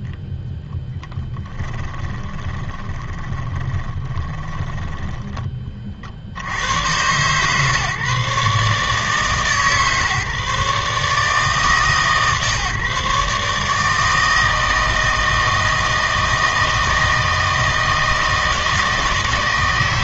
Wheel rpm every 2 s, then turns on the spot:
0, 20, 10, 100, 150, 150, 140, 160, 160, 160.
2-6